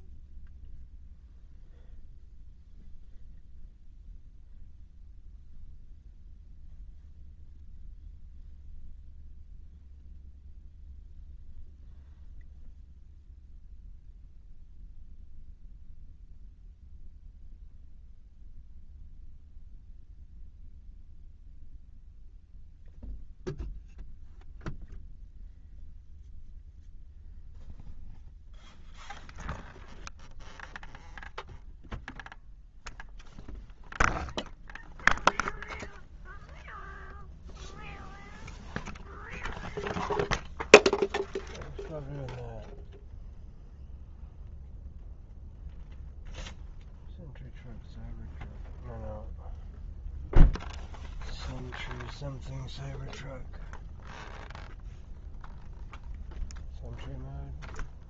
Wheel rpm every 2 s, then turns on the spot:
0, 0, 0, 0, 0, 0, 0, 0, 0, 0, 0, 0, 0, 0, 0, 0, 0, 0, 0, 0, 0, 0, 0, 0, 0, 0, 0, 0, 0.
none